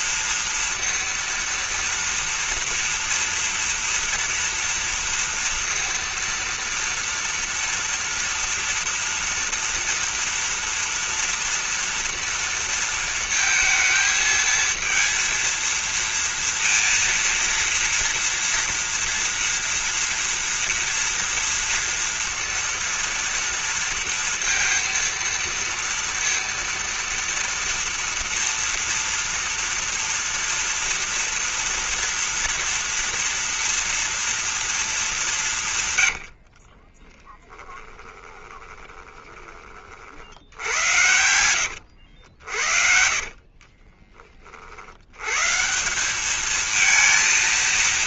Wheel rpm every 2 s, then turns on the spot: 230, 230, 230, 230, 230, 240, 230, 230, 230, 230, 230, 230, 230, 230, 230, 240, 240, 230, 50, 20, 80, 60, 70, 220.
36-40 42-44